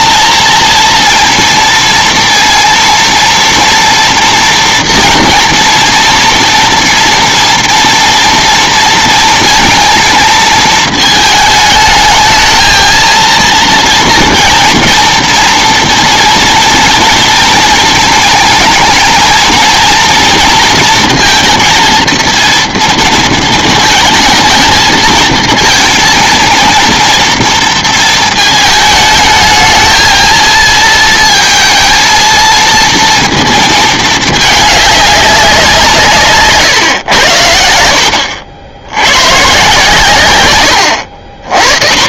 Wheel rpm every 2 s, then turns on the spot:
230, 230, 230, 230, 230, 220, 230, 230, 230, 220, 230, 230, 220, 230, 220, 230, 230, 210, 140, 80, 100.
none